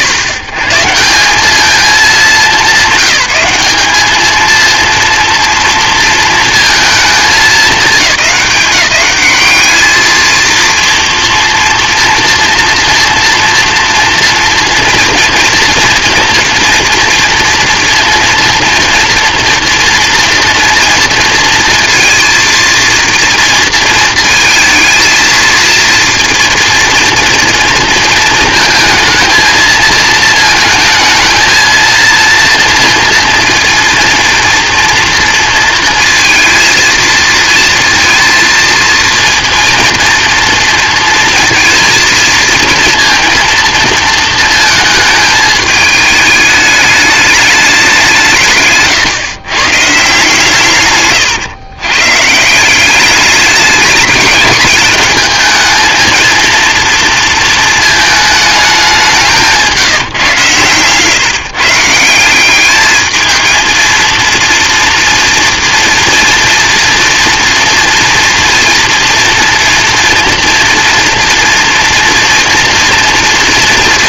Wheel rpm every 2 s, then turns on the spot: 140, 200, 230, 220, 190, 230, 230, 230, 230, 230, 230, 230, 220, 230, 220, 220, 230, 230, 230, 230, 230, 230, 230, 210, 150, 140, 190, 210, 230, 210, 130, 210, 230, 230, 230, 230, 240.
60-62